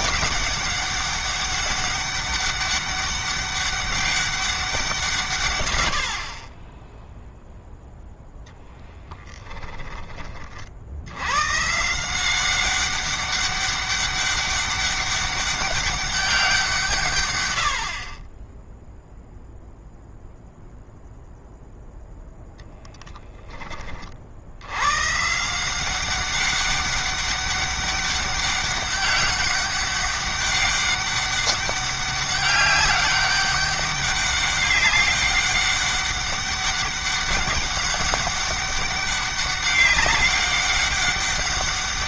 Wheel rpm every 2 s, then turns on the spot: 200, 200, 170, 10, 10, 60, 190, 200, 160, 0, 0, 20, 100, 200, 200, 200, 200, 200, 200, 200, 200.
8-10